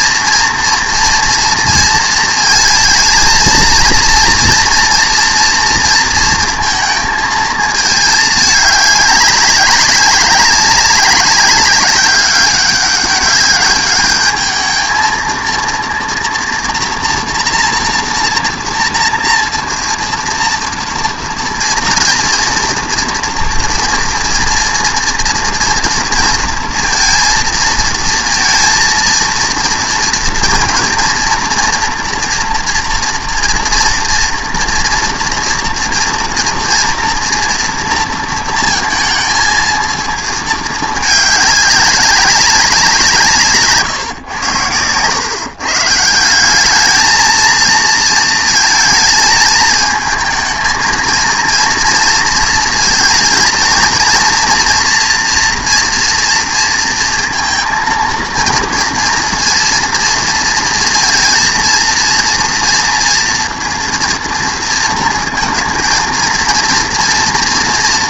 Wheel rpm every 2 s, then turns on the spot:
240, 230, 230, 230, 210, 200, 200, 220, 230, 240, 240, 230, 230, 230, 230, 230, 230, 230, 230, 220, 220, 180, 100, 200, 230, 220, 230, 240, 230, 230, 230, 230, 230, 230.
none